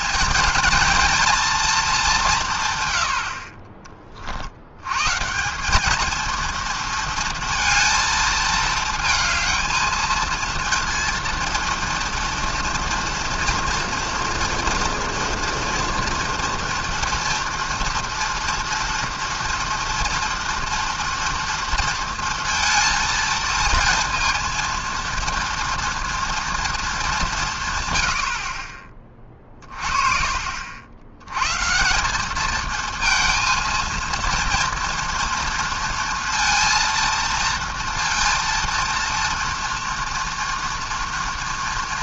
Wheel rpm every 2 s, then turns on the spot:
220, 140, 80, 230, 220, 230, 230, 230, 230, 230, 240, 230, 230, 230, 40, 50, 210, 230, 230, 230, 230.
none